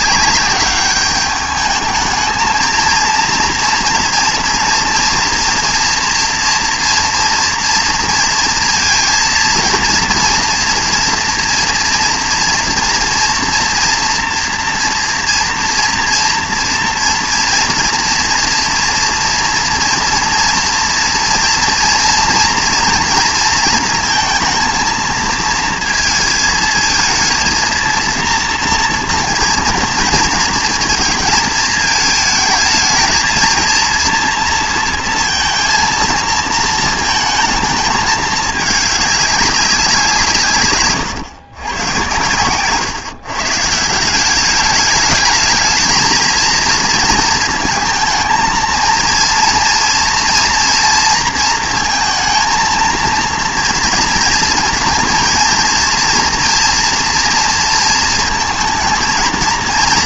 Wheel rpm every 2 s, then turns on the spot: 200, 220, 230, 230, 230, 230, 240, 240, 230, 240, 230, 230, 230, 220, 240, 230, 220, 230, 230, 210, 140, 110, 200, 230, 230, 240, 230, 230, 230, 220.
none